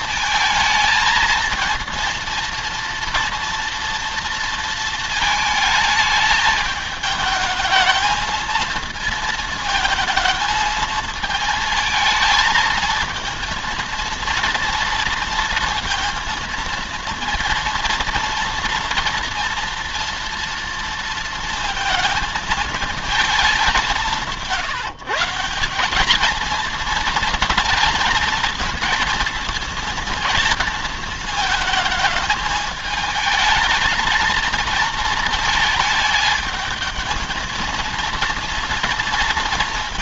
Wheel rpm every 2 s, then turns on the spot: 220, 230, 230, 220, 230, 220, 220, 230, 230, 230, 230, 220, 140, 230, 230, 220, 220, 230, 220, 230.
none